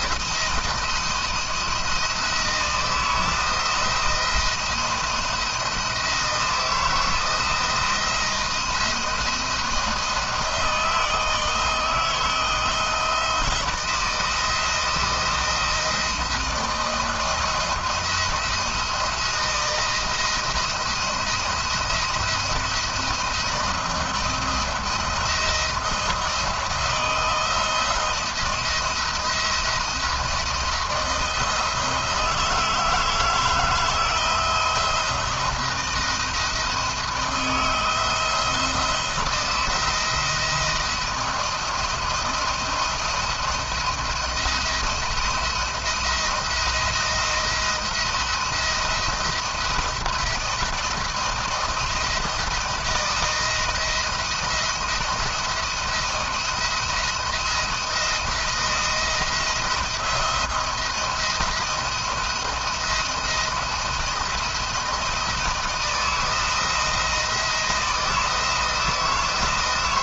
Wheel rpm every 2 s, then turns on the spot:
160, 160, 170, 160, 170, 160, 160, 160, 170, 170, 170, 170, 170, 170, 170, 170, 160, 160, 170, 170, 170, 170, 170, 170, 170, 170, 170, 170, 170, 170, 160, 170, 170, 160, 160.
none